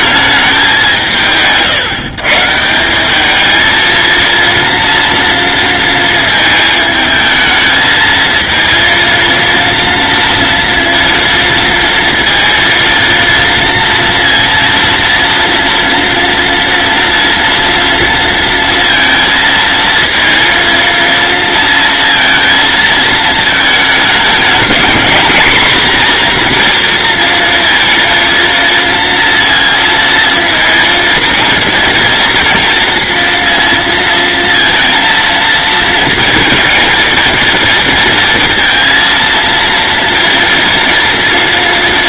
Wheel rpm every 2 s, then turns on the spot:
180, 170, 230, 220, 230, 230, 230, 230, 230, 230, 230, 220, 230, 240, 230, 230, 230, 230, 230, 230, 230.
none